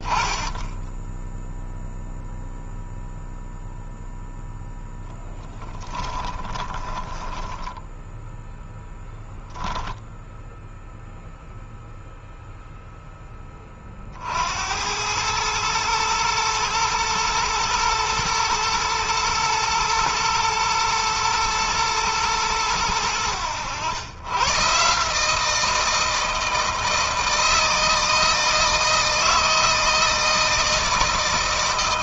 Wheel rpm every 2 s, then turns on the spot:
10, 0, 0, 20, 0, 0, 0, 80, 110, 120, 110, 100, 140, 160, 160, 160.
6-8